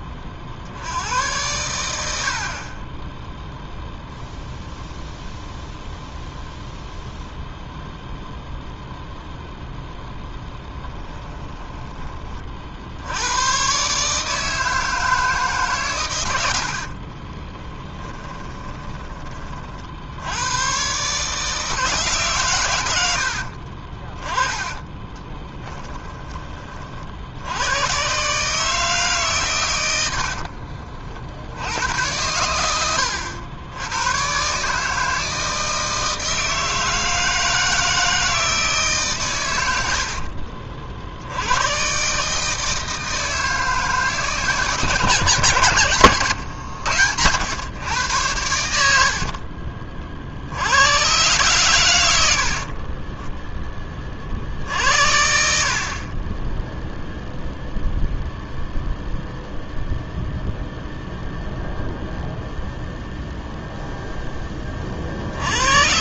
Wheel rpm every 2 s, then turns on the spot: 90, 20, 0, 0, 0, 10, 70, 160, 60, 20, 130, 90, 20, 50, 150, 50, 90, 150, 160, 140, 50, 160, 160, 110, 70, 110, 30, 70, 0, 0, 0, 0, 40.
10-12 16-20 24-26 48-50